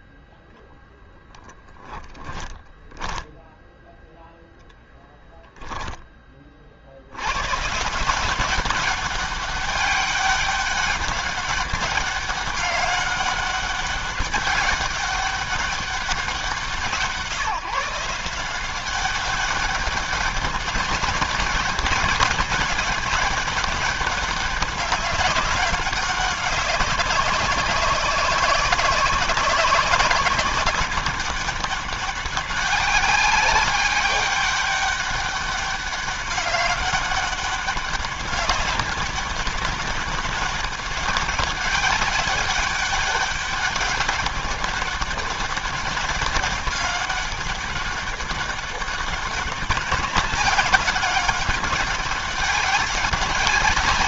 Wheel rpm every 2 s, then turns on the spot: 10, 10, 0, 60, 190, 200, 200, 200, 170, 190, 200, 200, 200, 200, 200, 200, 200, 200, 200, 200, 200, 200, 200, 200, 200, 210, 200.
none